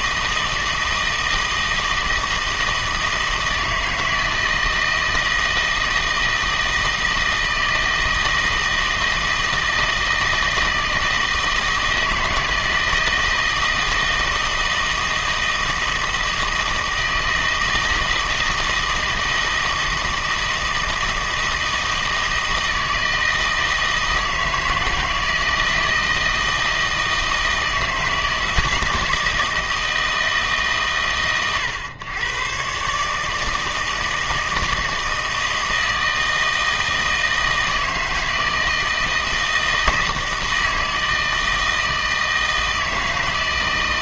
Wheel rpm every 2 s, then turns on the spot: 160, 160, 160, 160, 160, 160, 160, 160, 160, 160, 160, 160, 160, 160, 160, 150, 130, 160, 160, 160, 160, 160.
none